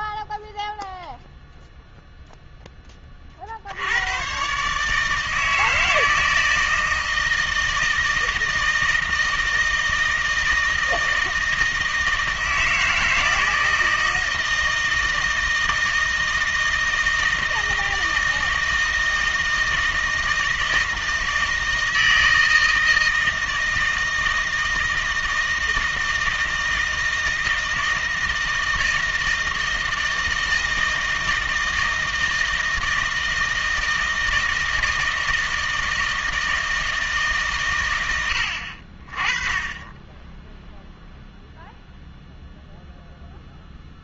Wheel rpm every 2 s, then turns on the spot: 0, 20, 150, 160, 160, 160, 160, 160, 160, 160, 160, 160, 160, 160, 160, 160, 160, 160, 160, 40, 0, 0.
none